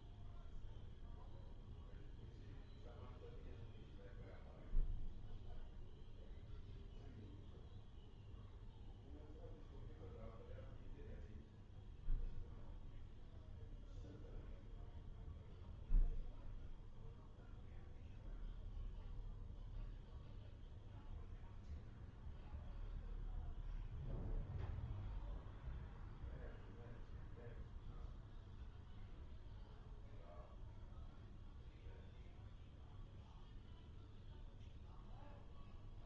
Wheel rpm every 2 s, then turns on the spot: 0, 0, 0, 0, 0, 0, 0, 0, 0, 0, 0, 0, 0, 0, 0, 0, 0, 0.
none